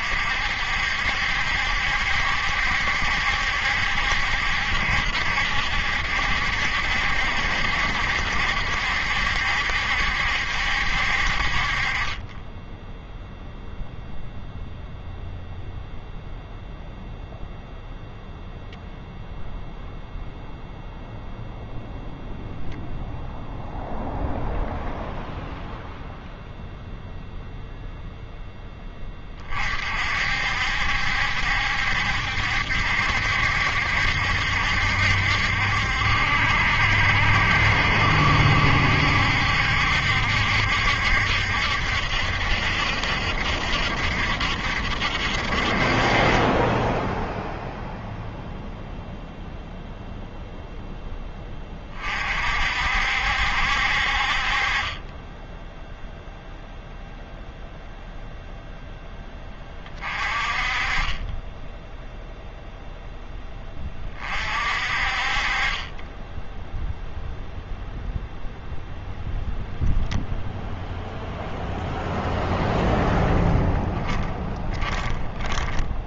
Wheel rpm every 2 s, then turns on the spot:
60, 70, 70, 70, 70, 70, 10, 0, 0, 0, 0, 0, 0, 0, 10, 60, 70, 70, 70, 70, 70, 70, 70, 20, 0, 0, 50, 40, 0, 0, 30, 0, 50, 0, 0, 0, 0, 10.
74-76